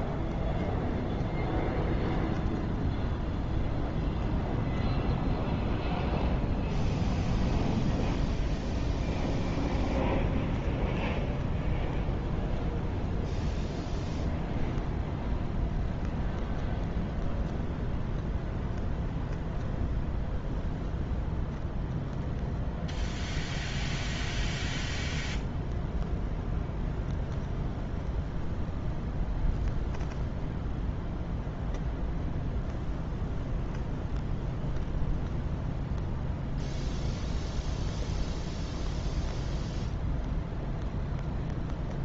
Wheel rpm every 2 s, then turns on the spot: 0, 0, 0, 0, 0, 0, 0, 0, 0, 0, 0, 0, 0, 0, 0, 0, 0, 0, 0, 0, 0.
none